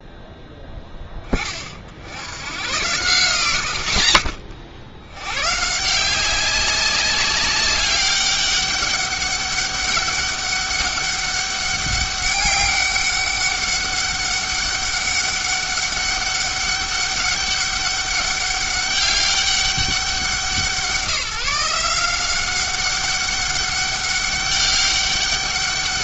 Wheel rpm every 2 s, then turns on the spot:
10, 100, 80, 200, 200, 200, 200, 200, 200, 200, 180, 200, 200.
none